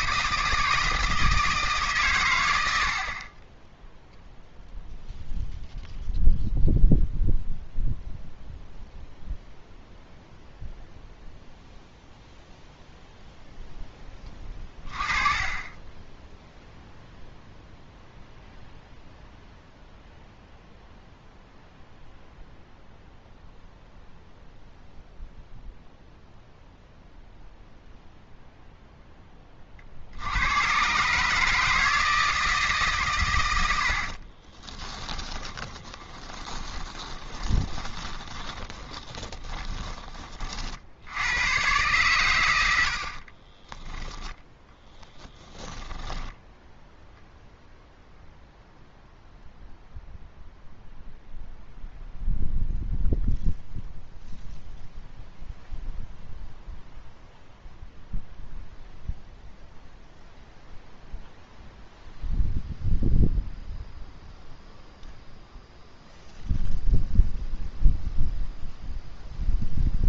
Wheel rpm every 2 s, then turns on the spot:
160, 70, 0, 0, 0, 0, 0, 20, 0, 0, 0, 0, 0, 0, 0, 120, 140, 20, 20, 20, 60, 70, 10, 0, 0, 0, 0, 0, 0, 0, 0, 0, 0, 0, 0.
34-40 44-46